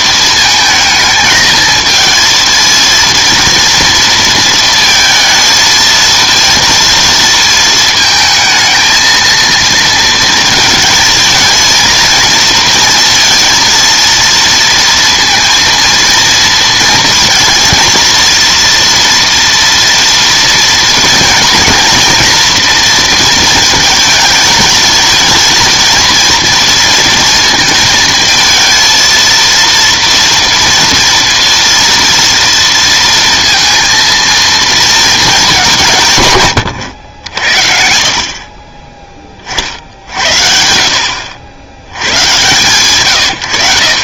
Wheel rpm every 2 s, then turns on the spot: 220, 230, 230, 230, 220, 230, 230, 230, 230, 230, 230, 240, 220, 230, 230, 230, 230, 230, 120, 40, 60, 120.
none